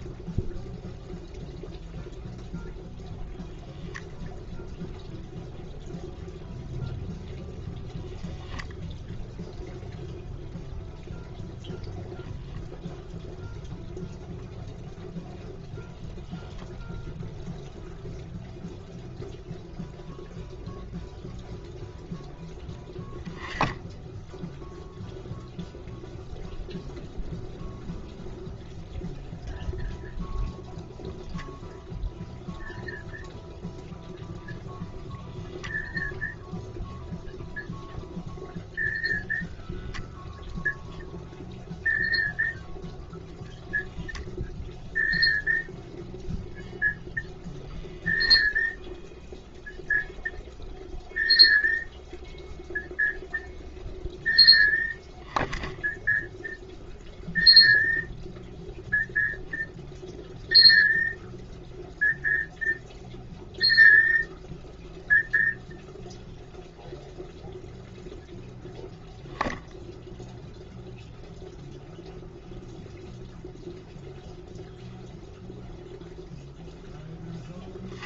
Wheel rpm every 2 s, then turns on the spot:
0, 0, 0, 0, 0, 0, 0, 0, 0, 0, 0, 10, 0, 0, 0, 0, 0, 0, 0, 0, 0, 0, 0, 0, 0, 0, 0, 0, 0, 0, 0, 0, 0, 0, 0, 0, 0, 0, 0.
none